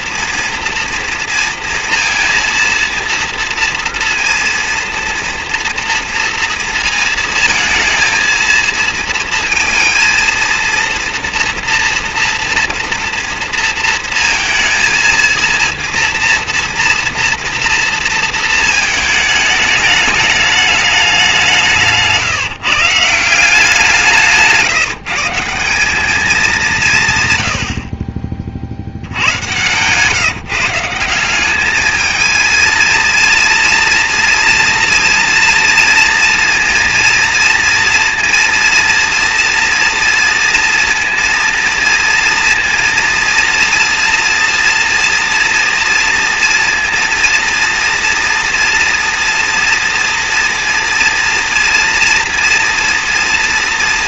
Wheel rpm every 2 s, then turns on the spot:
240, 230, 230, 230, 230, 230, 230, 230, 230, 220, 210, 150, 160, 190, 50, 160, 220, 230, 230, 230, 230, 230, 230, 230, 230, 230, 230.
none